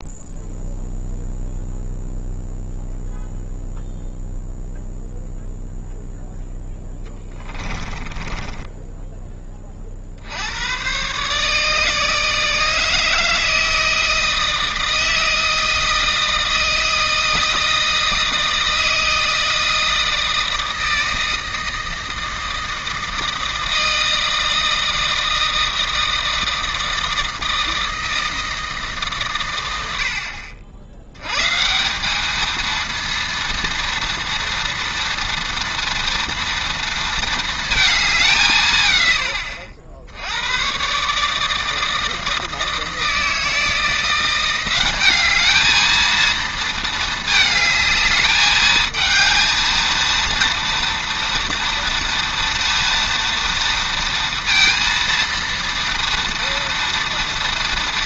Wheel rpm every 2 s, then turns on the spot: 0, 0, 0, 10, 10, 100, 160, 160, 160, 160, 160, 160, 160, 160, 160, 70, 220, 230, 230, 140, 110, 160, 190, 230, 220, 230, 230, 230, 230.
8-10